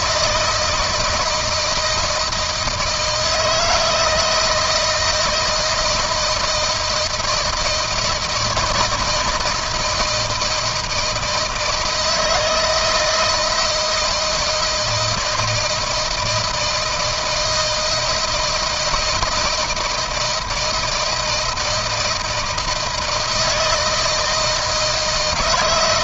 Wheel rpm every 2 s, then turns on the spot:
160, 160, 160, 160, 160, 160, 160, 160, 160, 160, 160, 170, 160.
none